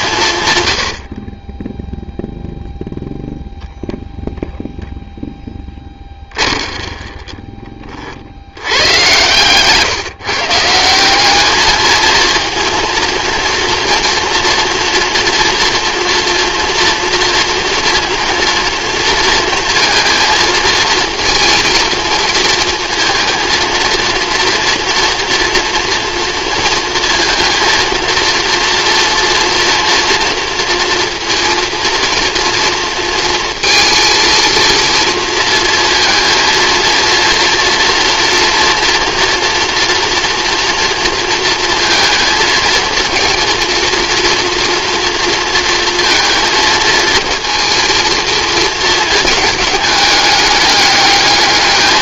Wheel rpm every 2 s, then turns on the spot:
120, 0, 0, 30, 90, 150, 230, 230, 240, 230, 230, 220, 240, 220, 230, 230, 230, 230, 230, 230, 230, 230, 230, 230, 230, 210.
6-8